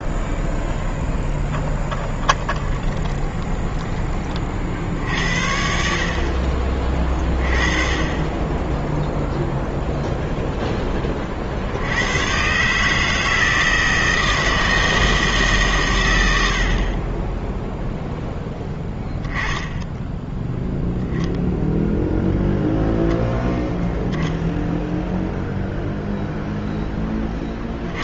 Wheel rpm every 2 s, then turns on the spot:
10, 20, 50, 40, 10, 0, 130, 160, 80, 0, 0, 0, 0, 0.
2-4